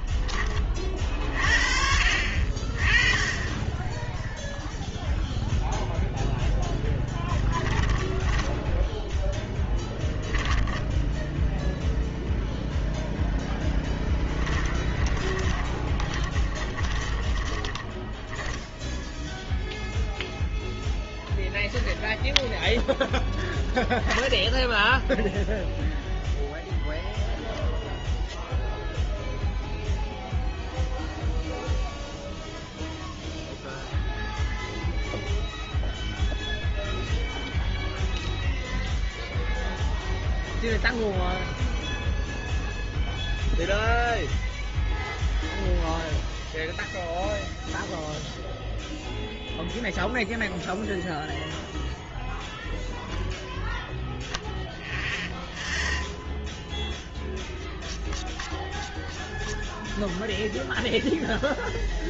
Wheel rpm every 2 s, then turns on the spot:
40, 30, 0, 10, 10, 10, 0, 10, 20, 10, 0, 0, 0, 0, 0, 0, 0, 0, 0, 0, 0, 0, 0, 0, 0, 0, 0, 0, 0, 0, 0.
6-10 14-20